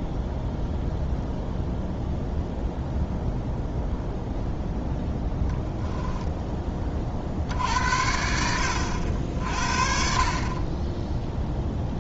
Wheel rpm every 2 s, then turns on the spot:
0, 0, 0, 30, 70, 10.
none